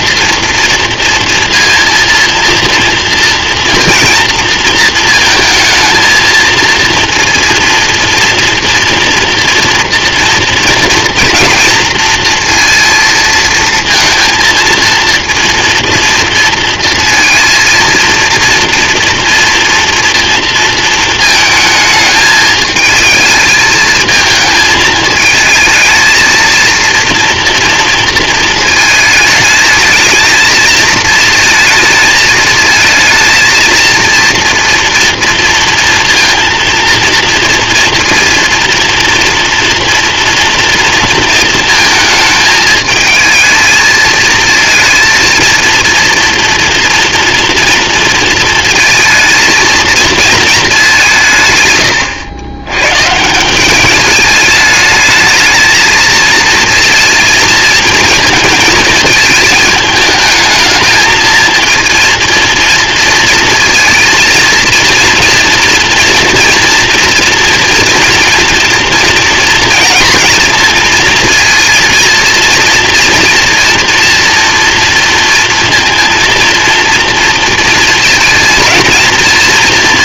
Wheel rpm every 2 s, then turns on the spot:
230, 230, 230, 230, 230, 230, 230, 230, 230, 230, 220, 220, 220, 230, 220, 220, 220, 240, 230, 230, 230, 220, 230, 230, 230, 190, 120, 210, 220, 220, 220, 230, 230, 240, 240, 230, 230, 230, 230, 230.
none